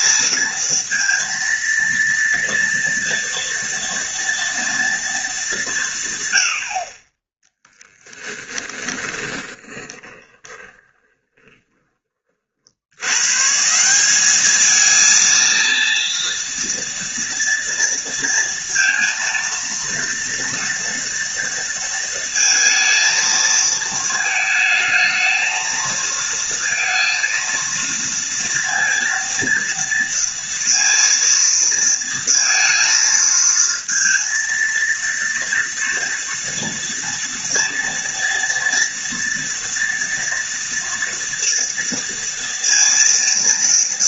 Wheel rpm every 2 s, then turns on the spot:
230, 230, 230, 60, 10, 20, 80, 220, 230, 230, 230, 230, 220, 230, 230, 230, 230, 230, 230, 240, 230, 230.
8-12